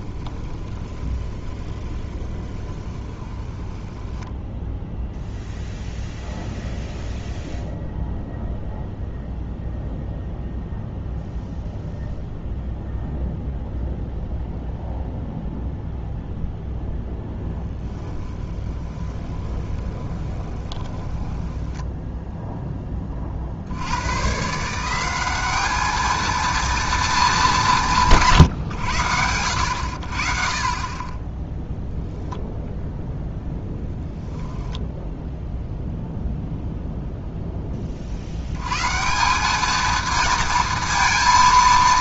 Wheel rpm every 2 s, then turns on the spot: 20, 20, 0, 0, 0, 0, 0, 0, 0, 20, 20, 10, 170, 230, 110, 30, 0, 0, 0, 120, 230.
0-4 18-22